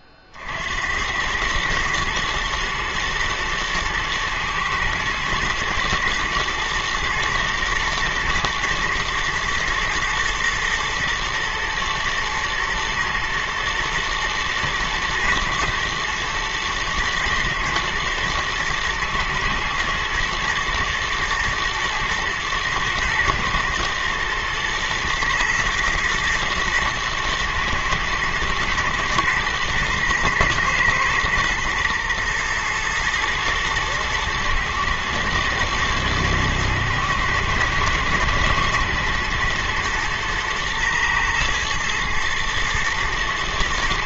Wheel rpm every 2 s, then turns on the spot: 60, 120, 110, 110, 110, 120, 120, 110, 110, 110, 110, 110, 120, 110, 110, 120, 120, 110, 110, 120, 110, 120.
none